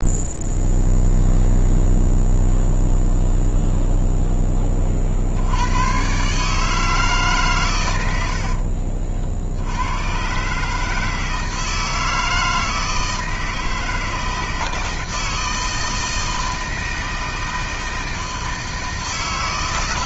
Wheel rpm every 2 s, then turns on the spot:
0, 0, 20, 150, 60, 150, 160, 160, 160, 160.
8-10